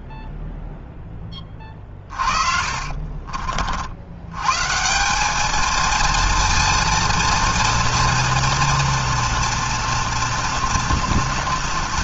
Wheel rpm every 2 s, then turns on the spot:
0, 40, 130, 230, 230, 230.
2-4